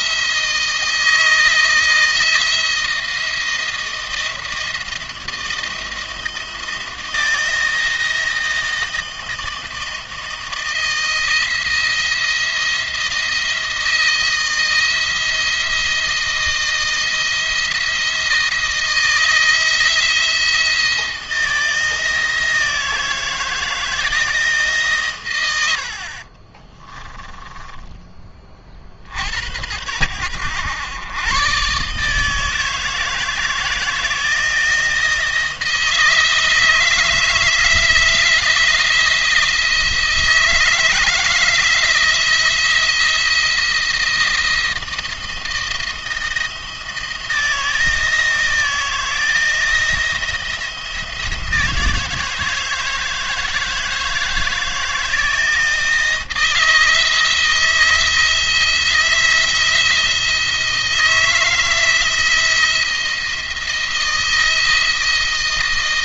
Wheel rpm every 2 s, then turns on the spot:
160, 160, 160, 160, 160, 160, 170, 170, 160, 160, 170, 160, 150, 40, 40, 110, 160, 160, 160, 170, 160, 170, 170, 160, 160, 170, 160, 160, 160, 170, 170, 170, 160.
26-28